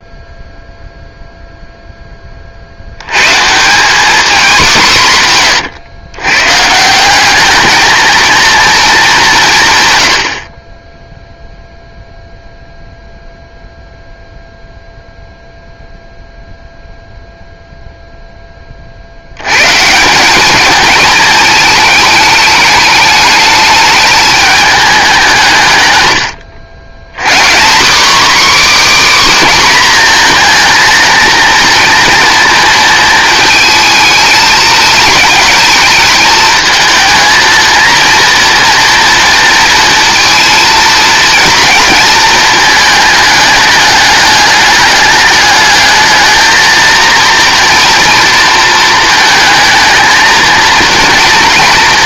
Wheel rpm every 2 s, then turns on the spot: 0, 70, 200, 150, 230, 20, 0, 0, 0, 30, 210, 210, 210, 110, 290, 230, 230, 220, 220, 230, 230, 220, 210, 230, 230, 230.
none